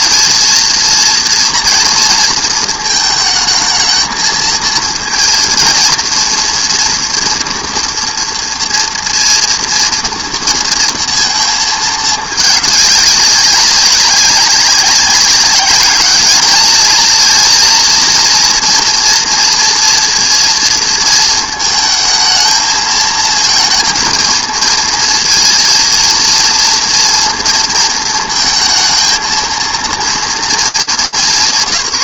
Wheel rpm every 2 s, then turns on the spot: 230, 220, 230, 230, 240, 230, 210, 190, 210, 230, 230, 220, 230, 230, 230, 210.
none